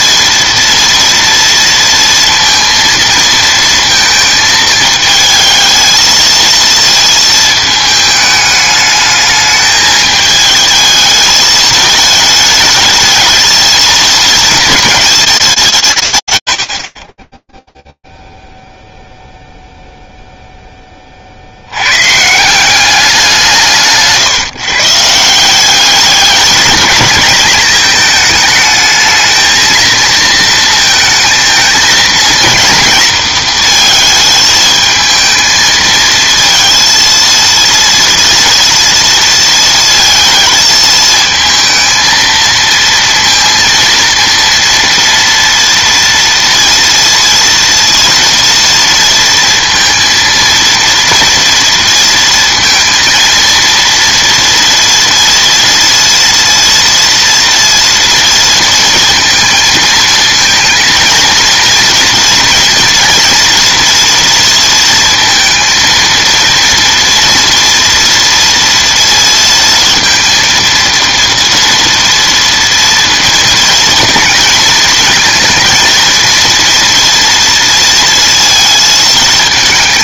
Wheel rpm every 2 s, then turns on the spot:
230, 230, 220, 230, 210, 220, 220, 230, 80, 0, 10, 190, 140, 220, 220, 220, 230, 220, 230, 230, 230, 230, 230, 230, 230, 230, 230, 230, 230, 230, 230, 230, 230, 230, 230, 230, 230, 220, 230, 220.
none